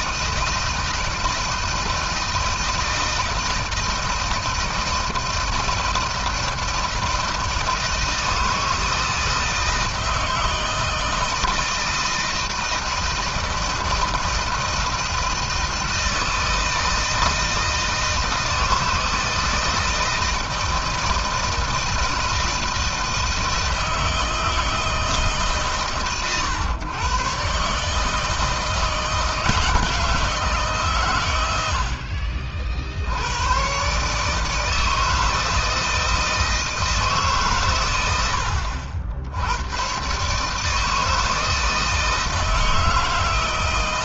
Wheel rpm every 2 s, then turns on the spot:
160, 160, 160, 160, 160, 160, 160, 160, 160, 160, 160, 160, 160, 120, 160, 140, 70, 160, 160, 70, 160, 160.
none